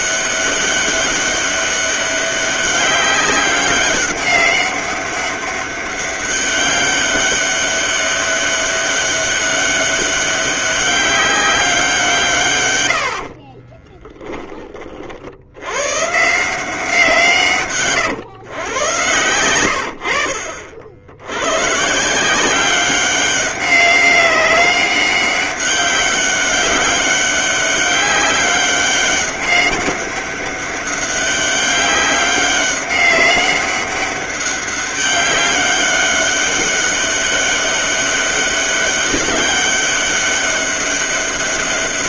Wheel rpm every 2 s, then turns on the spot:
200, 200, 200, 200, 200, 200, 100, 30, 170, 110, 70, 190, 200, 190, 200, 200, 200, 200, 190, 200, 200.
none